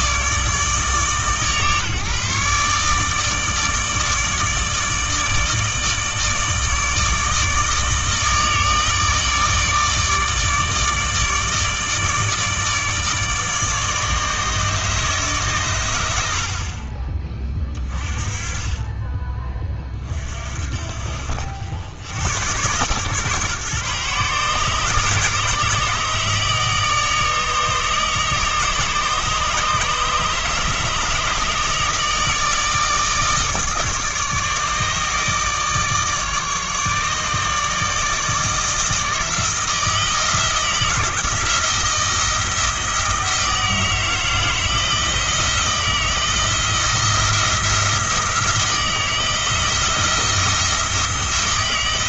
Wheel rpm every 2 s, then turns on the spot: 150, 150, 150, 150, 150, 150, 150, 150, 50, 20, 50, 130, 140, 150, 150, 150, 160, 150, 150, 160, 160, 160, 160, 170, 160, 170.
none